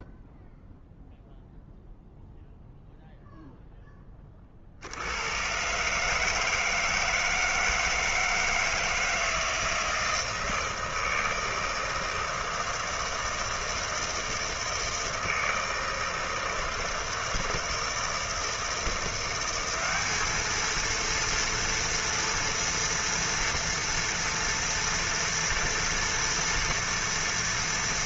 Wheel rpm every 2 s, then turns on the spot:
0, 0, 30, 150, 160, 160, 160, 160, 160, 160, 220, 230, 230, 230.
none